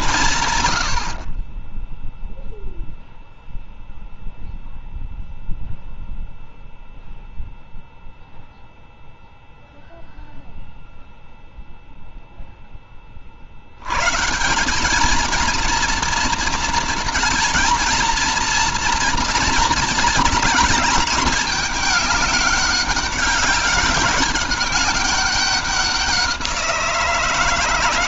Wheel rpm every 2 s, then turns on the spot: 150, 0, 0, 0, 0, 0, 0, 150, 230, 230, 220, 200, 200, 180.
none